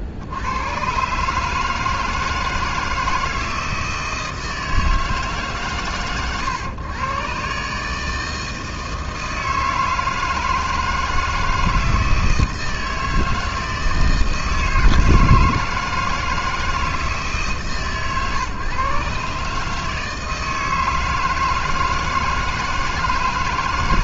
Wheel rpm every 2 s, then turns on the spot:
80, 160, 160, 110, 160, 160, 160, 160, 160, 130, 160, 160.
none